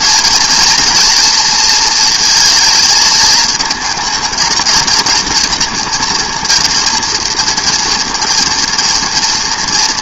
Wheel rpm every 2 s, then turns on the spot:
230, 220, 220, 240, 240.
none